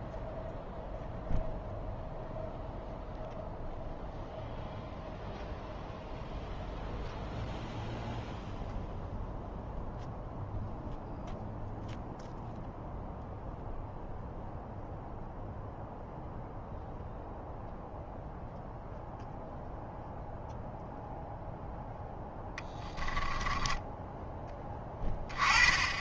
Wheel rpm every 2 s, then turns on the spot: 0, 0, 0, 0, 0, 0, 0, 0, 0, 0, 0, 20, 10.
22-24